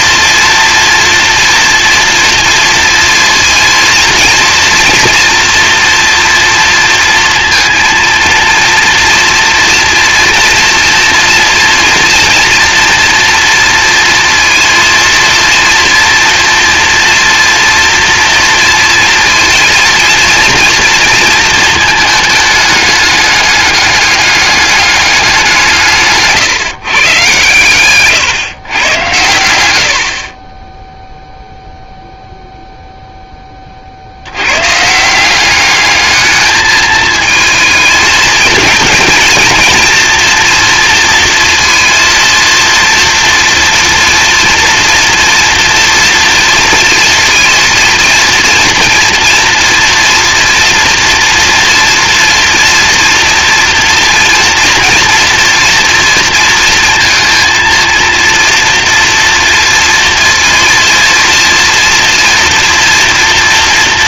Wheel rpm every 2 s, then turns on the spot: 230, 230, 230, 230, 230, 230, 230, 230, 230, 230, 230, 220, 200, 150, 130, 60, 0, 110, 210, 220, 230, 230, 230, 230, 230, 230, 230, 230, 230, 230, 230, 230.
none